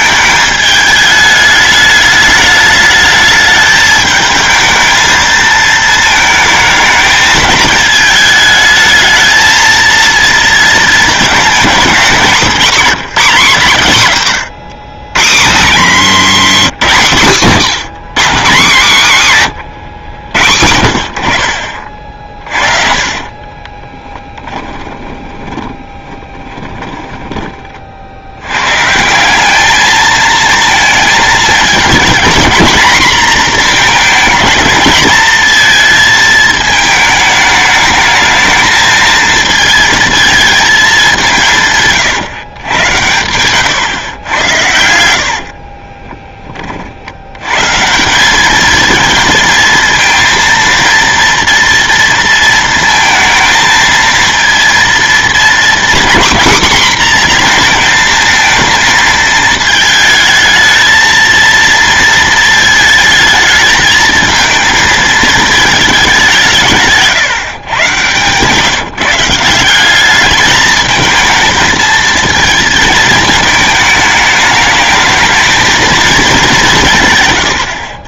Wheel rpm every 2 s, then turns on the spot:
210, 210, 220, 220, 220, 220, 240, 120, 170, 170, 80, 30, 20, 20, 150, 230, 220, 220, 220, 220, 210, 110, 80, 50, 220, 230, 230, 230, 250, 220, 220, 220, 220, 150, 150, 220, 220, 220, 160.
22-28 66-68